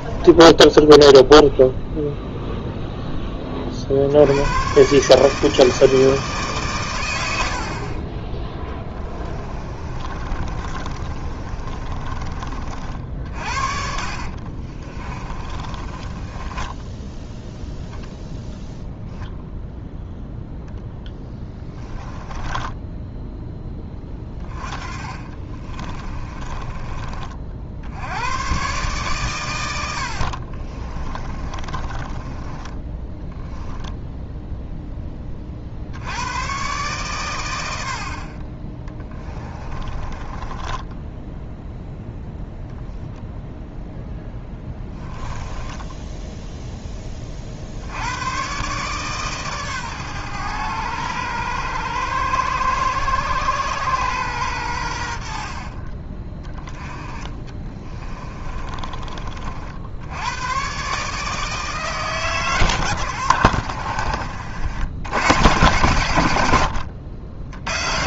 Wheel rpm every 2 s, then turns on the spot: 10, 0, 130, 130, 10, 30, 40, 40, 20, 0, 0, 10, 20, 30, 130, 40, 20, 0, 120, 20, 10, 0, 10, 0, 120, 110, 110, 100, 20, 30, 130, 110, 80, 90.
0-2 8-12 14-18 22-28 30-34 40-42 44-46 58-60